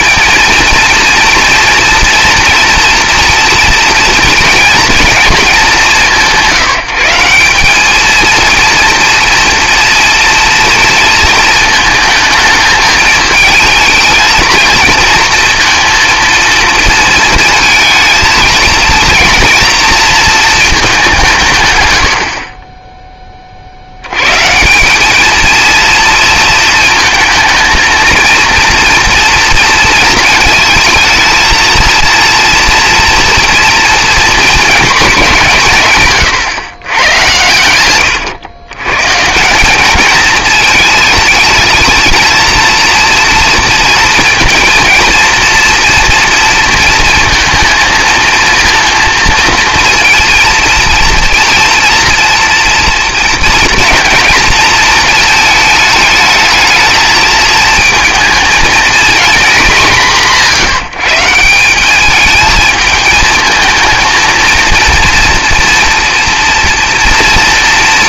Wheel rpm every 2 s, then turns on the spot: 230, 230, 240, 170, 230, 230, 220, 230, 230, 230, 220, 20, 170, 220, 230, 220, 230, 220, 120, 130, 220, 230, 230, 230, 230, 230, 240, 230, 220, 230, 180, 220, 230, 230.
none